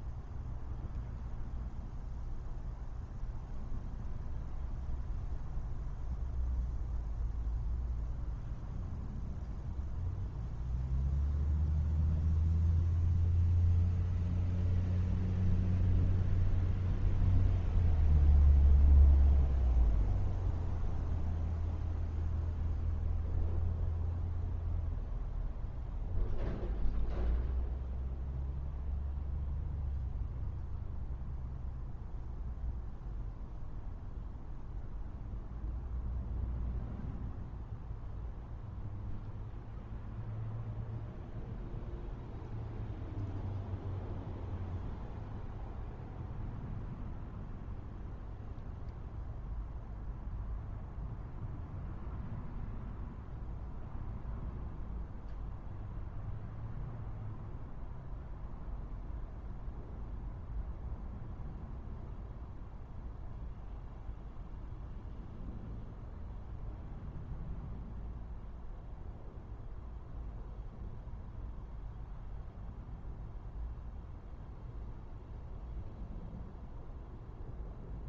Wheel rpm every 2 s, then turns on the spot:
0, 0, 0, 0, 0, 0, 0, 0, 0, 0, 0, 0, 0, 0, 0, 0, 0, 0, 0, 0, 0, 0, 0, 0, 0, 0, 0, 0, 0, 0, 0, 0, 0, 0, 0, 0, 0, 0, 0.
none